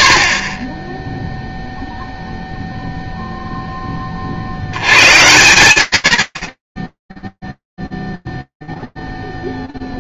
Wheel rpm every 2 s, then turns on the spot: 20, 0, 60, 20, 0.
none